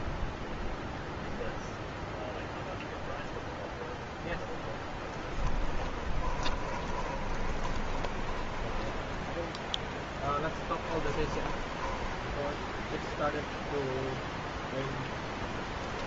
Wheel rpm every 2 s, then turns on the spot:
0, 0, 10, 20, 10, 20, 0, 0.
6-12